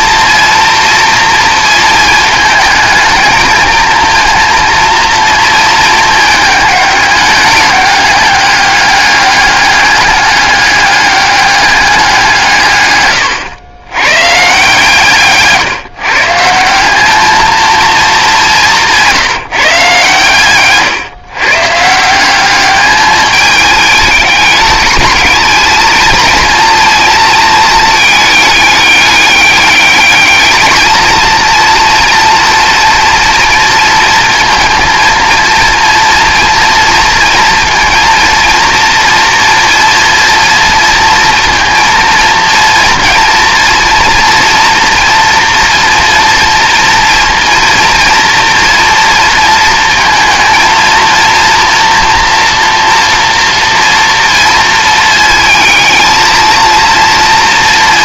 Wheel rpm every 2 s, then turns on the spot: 230, 220, 230, 210, 200, 200, 150, 140, 180, 180, 130, 200, 210, 230, 210, 220, 230, 230, 230, 230, 230, 230, 240, 230, 230, 230, 230, 230, 230.
none